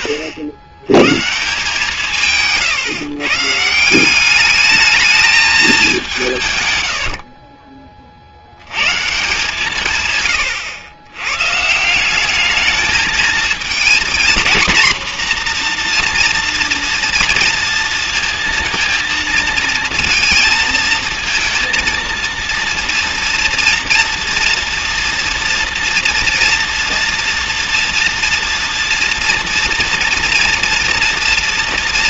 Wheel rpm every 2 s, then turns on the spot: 110, 160, 200, 170, 60, 130, 210, 240, 240, 230, 230, 230, 240, 230, 230, 230.
none